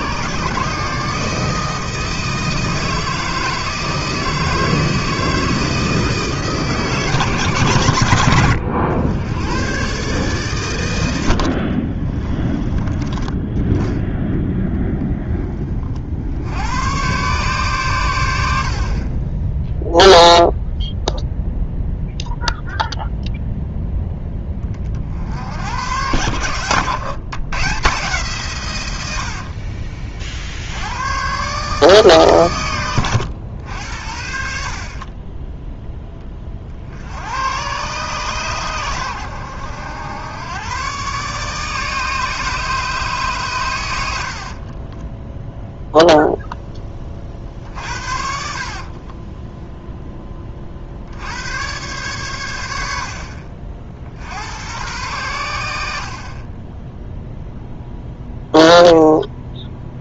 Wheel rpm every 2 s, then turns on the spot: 150, 160, 160, 150, 100, 100, 30, 10, 110, 50, 0, 0, 40, 110, 120, 80, 100, 40, 60, 110, 120, 150, 20, 20, 50, 40, 80, 100, 10, 0.
12-14 26-28 44-46 48-50